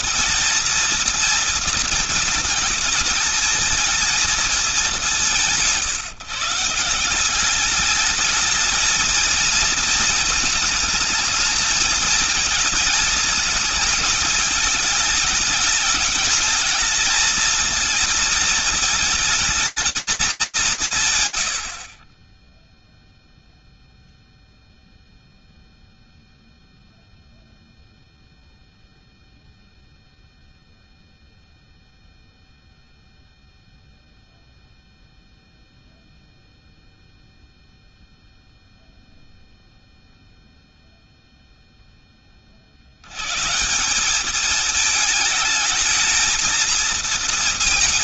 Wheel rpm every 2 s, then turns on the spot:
230, 220, 200, 160, 220, 230, 220, 210, 220, 220, 160, 0, 0, 0, 0, 0, 0, 0, 0, 0, 20, 190, 220, 220.
none